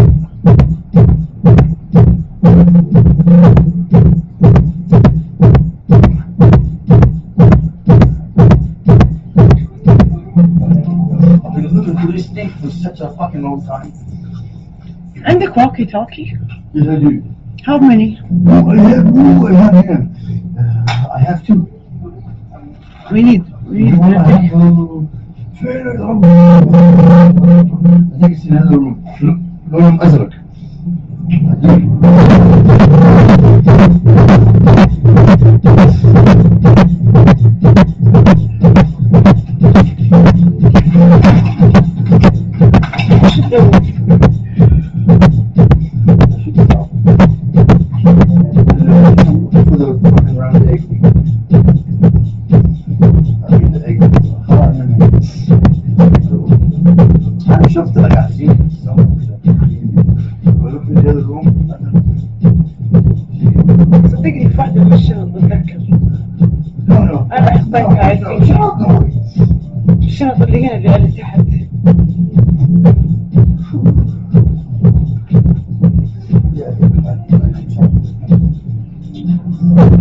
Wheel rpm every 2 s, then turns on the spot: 0, 0, 0, 0, 0, 0, 0, 0, 0, 0, 0, 0, 0, 0, 0, 0, 0, 0, 0, 0, 0, 0, 0, 0, 0, 0, 0, 0, 0, 0, 0, 0, 0, 0, 0, 0, 0, 0, 0, 0.
none